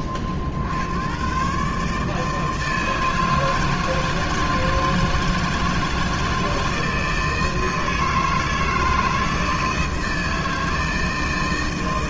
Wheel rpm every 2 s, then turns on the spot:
60, 160, 160, 160, 160, 160.
none